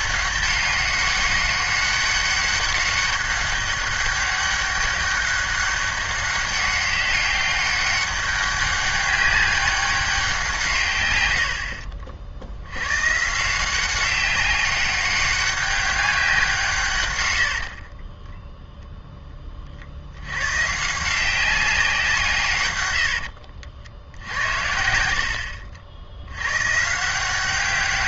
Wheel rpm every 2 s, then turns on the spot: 200, 200, 200, 200, 200, 160, 70, 200, 150, 0, 130, 130, 60, 120.
24-26